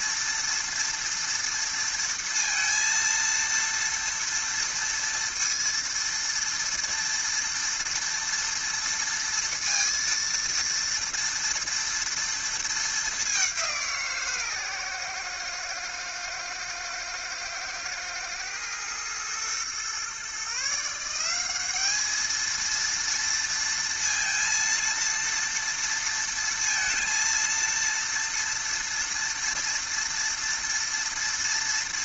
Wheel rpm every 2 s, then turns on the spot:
230, 230, 230, 230, 230, 230, 210, 120, 110, 110, 170, 230, 230, 230, 230, 230.
none